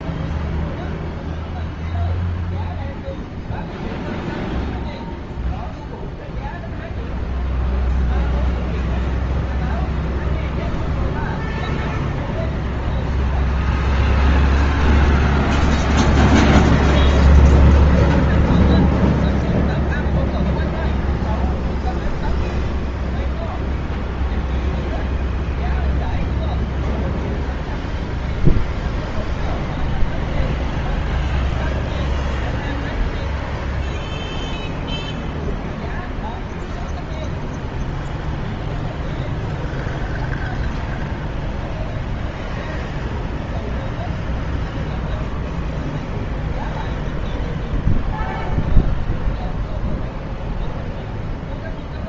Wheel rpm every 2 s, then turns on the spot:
0, 0, 0, 0, 0, 0, 0, 0, 0, 0, 0, 0, 0, 0, 0, 0, 0, 0, 0, 0, 0, 0, 0, 0, 0, 0.
none